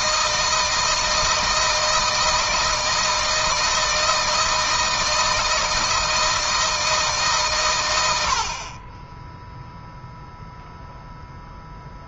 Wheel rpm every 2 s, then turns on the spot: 160, 160, 160, 160, 50, 0.
none